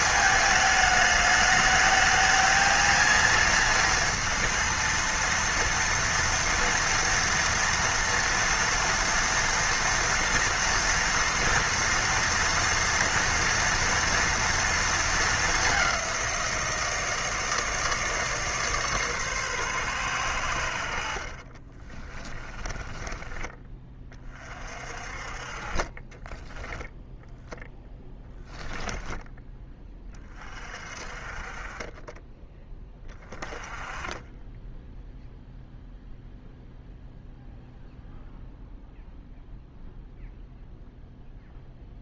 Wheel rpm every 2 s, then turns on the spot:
220, 230, 230, 230, 230, 230, 230, 230, 160, 150, 80, 20, 40, 10, 10, 40, 20, 10, 0, 0, 0.
22-24 26-30